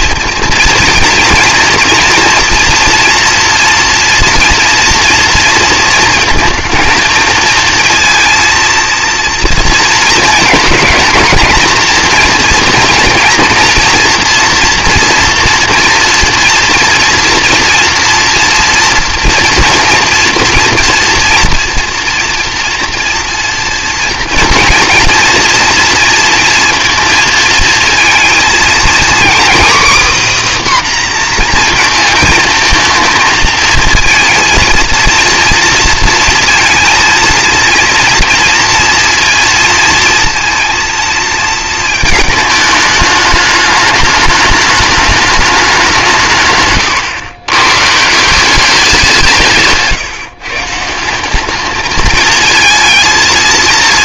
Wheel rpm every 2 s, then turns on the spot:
230, 230, 230, 230, 230, 230, 230, 240, 230, 230, 240, 230, 230, 230, 230, 280, 230, 230, 230, 230, 230, 210, 210, 120, 190, 150, 230.
46-48